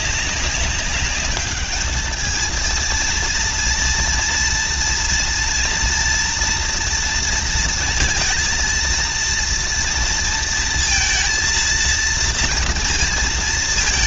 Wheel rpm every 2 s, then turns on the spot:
190, 220, 230, 230, 230, 230, 230.
none